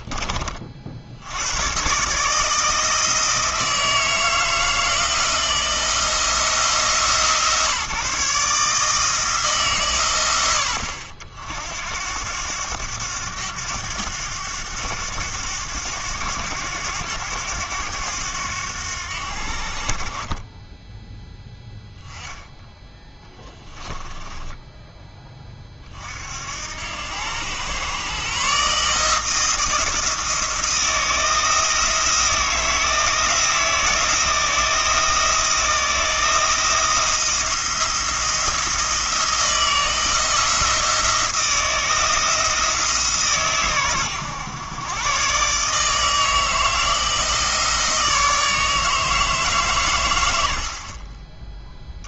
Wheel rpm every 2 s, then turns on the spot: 50, 160, 160, 160, 160, 70, 100, 100, 90, 90, 10, 10, 10, 90, 150, 170, 160, 160, 170, 170, 170, 160, 120, 160, 160, 40.
none